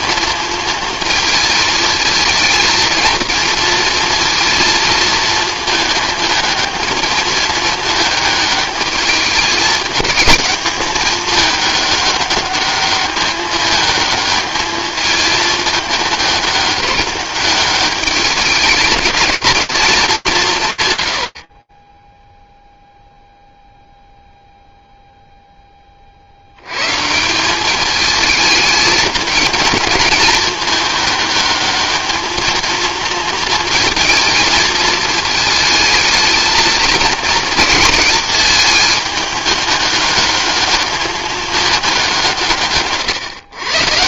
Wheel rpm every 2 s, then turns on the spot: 220, 230, 230, 210, 210, 210, 210, 210, 200, 210, 200, 0, 0, 140, 220, 210, 230, 230, 230, 210, 210, 140.
42-44